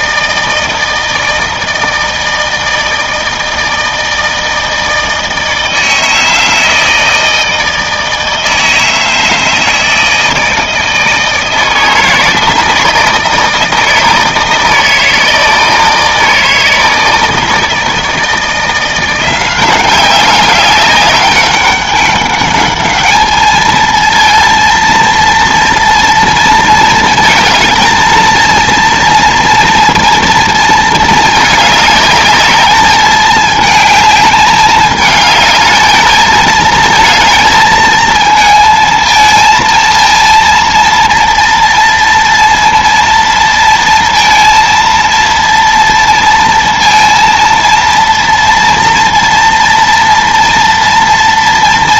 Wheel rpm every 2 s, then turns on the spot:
160, 160, 160, 160, 160, 160, 160, 160, 160, 160, 190, 200, 230, 230, 230, 230, 210, 210, 220, 220, 230, 230, 230, 230, 230, 230.
none